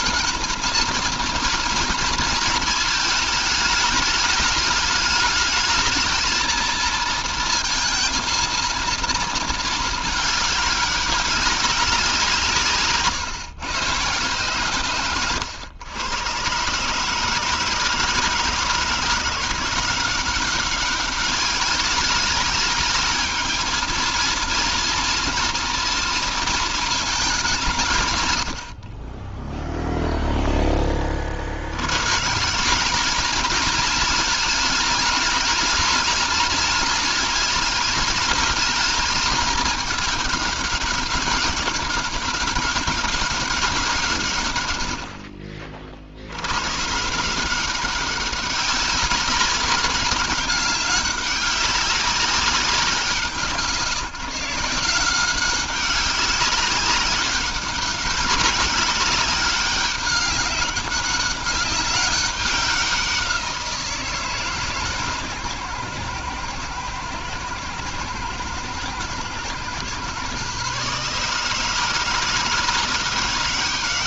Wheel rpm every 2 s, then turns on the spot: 230, 220, 210, 230, 230, 200, 150, 110, 150, 160, 200, 220, 230, 210, 30, 30, 200, 210, 220, 220, 200, 200, 80, 150, 200, 200, 180, 180, 200, 190, 190, 180, 140, 110, 110, 150, 180.
none